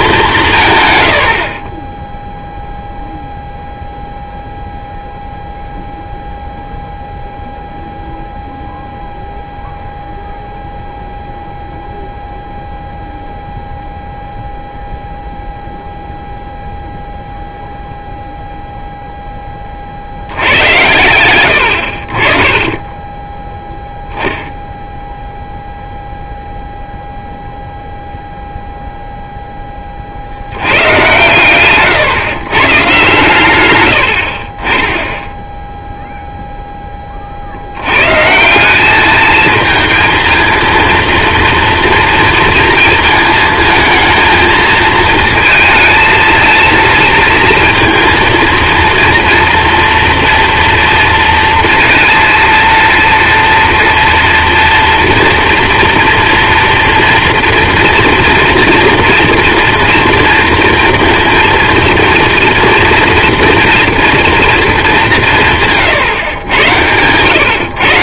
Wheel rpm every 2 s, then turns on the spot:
160, 0, 0, 0, 0, 0, 0, 0, 0, 0, 80, 30, 0, 0, 0, 80, 130, 50, 0, 160, 230, 230, 220, 220, 230, 230, 230, 230, 230, 230, 230, 230, 230, 110.
none